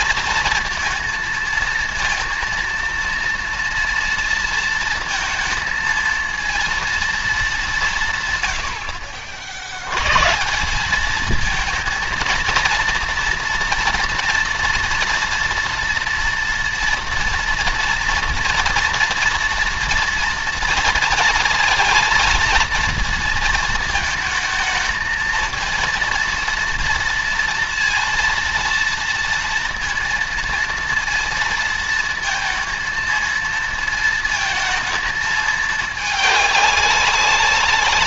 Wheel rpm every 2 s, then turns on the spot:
230, 230, 230, 230, 80, 190, 230, 230, 230, 230, 230, 230, 220, 230, 230, 230, 230, 220, 200.
none